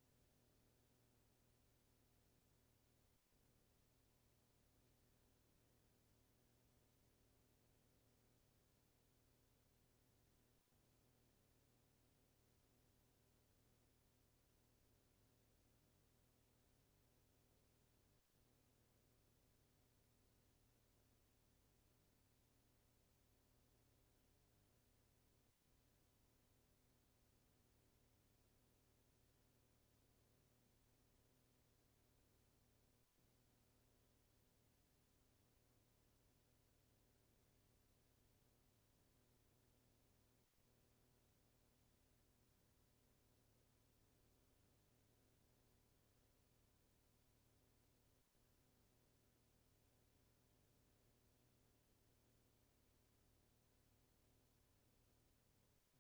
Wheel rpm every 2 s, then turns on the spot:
0, 0, 0, 0, 0, 0, 0, 0, 0, 0, 0, 0, 0, 0, 0, 0, 0, 0, 0, 0, 0, 0, 0, 0, 0, 0, 0, 0.
none